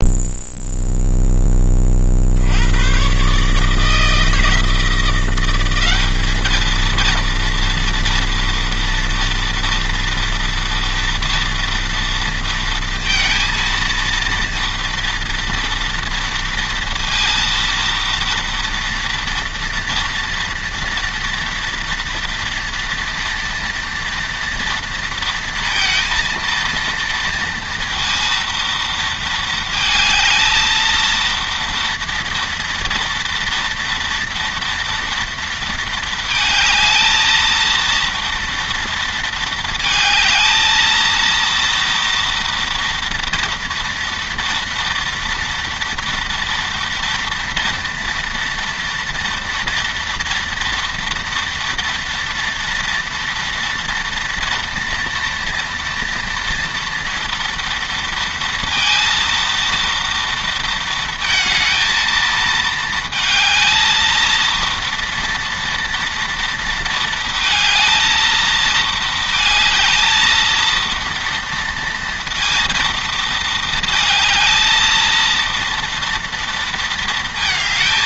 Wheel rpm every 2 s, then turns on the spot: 0, 110, 170, 220, 230, 230, 230, 230, 230, 230, 230, 230, 230, 230, 230, 230, 240, 230, 220, 230, 230, 230, 230, 230, 230, 230, 230, 230, 230, 230, 230, 220, 230, 230, 220, 230, 230, 230, 230.
none